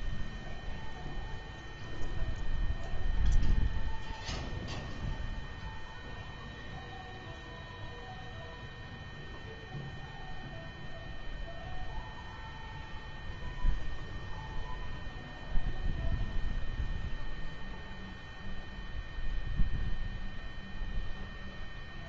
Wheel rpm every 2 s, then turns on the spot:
0, 0, 0, 0, 0, 0, 0, 0, 0, 0, 0.
none